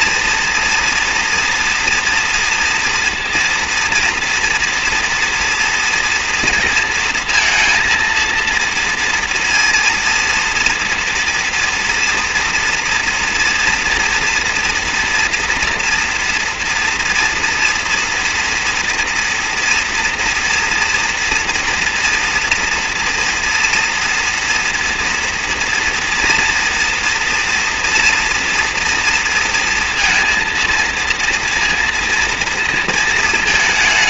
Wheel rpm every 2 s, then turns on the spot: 230, 230, 230, 230, 230, 230, 230, 230, 230, 230, 240, 230, 230, 230, 230, 230, 230.
none